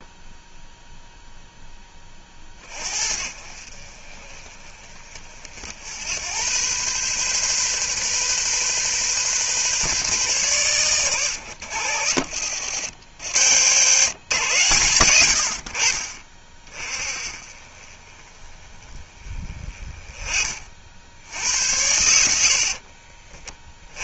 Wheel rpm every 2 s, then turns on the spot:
0, 40, 30, 110, 130, 130, 90, 130, 30, 20, 40, 60.
22-24